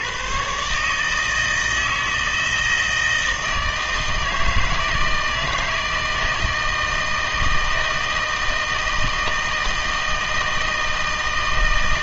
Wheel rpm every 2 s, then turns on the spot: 140, 160, 160, 160, 160, 160.
none